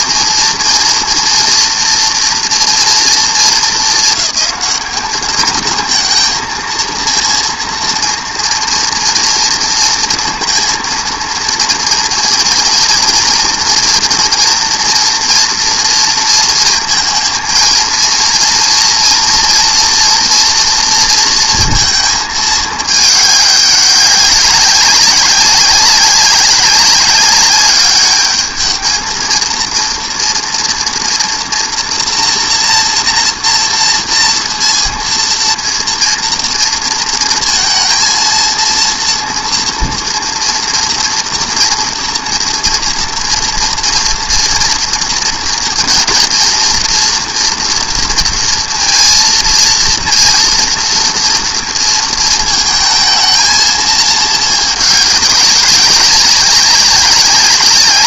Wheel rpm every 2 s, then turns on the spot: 230, 230, 220, 230, 230, 230, 230, 230, 230, 230, 230, 220, 190, 200, 220, 230, 240, 230, 230, 230, 230, 230, 230, 230, 230, 230, 220, 220, 190.
none